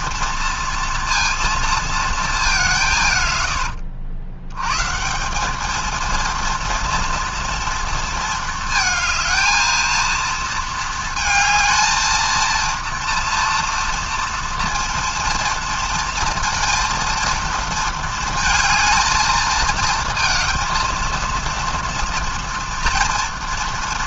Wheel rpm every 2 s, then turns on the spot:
230, 210, 110, 230, 230, 230, 230, 230, 230, 230, 230, 230.
none